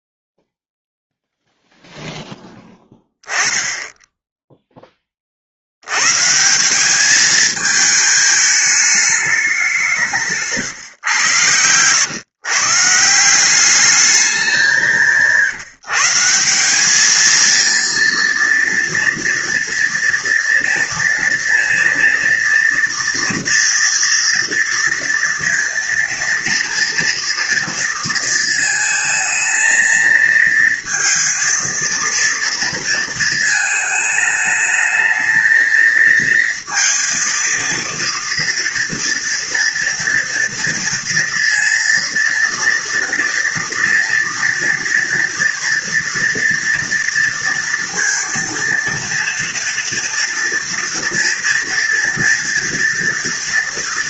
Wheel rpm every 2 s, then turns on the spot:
0, 10, 10, 160, 220, 150, 140, 190, 190, 240, 230, 240, 230, 230, 230, 230, 230, 220, 230, 230, 230, 230, 230, 230, 230, 230, 230.
none